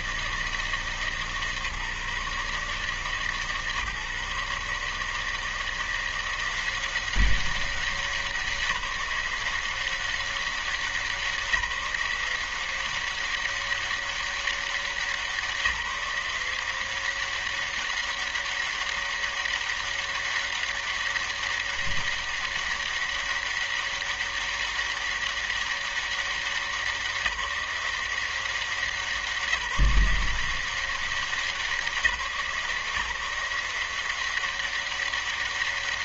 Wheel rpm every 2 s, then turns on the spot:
160, 150, 150, 170, 190, 190, 170, 200, 180, 200, 200, 200, 200, 200, 180, 180, 160, 180.
none